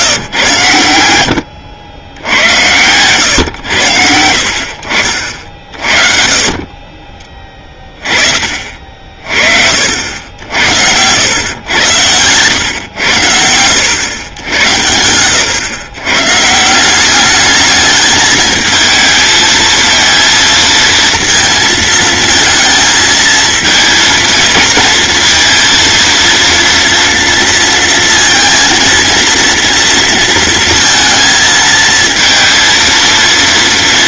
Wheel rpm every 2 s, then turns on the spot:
100, 110, 70, 30, 40, 80, 100, 90, 170, 220, 230, 220, 220, 230, 230, 230, 230.
none